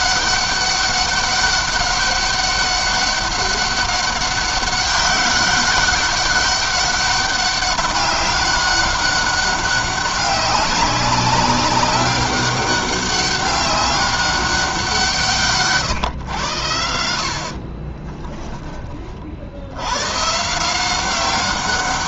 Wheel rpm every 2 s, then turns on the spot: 200, 200, 200, 200, 200, 190, 200, 180, 90, 20, 160.
none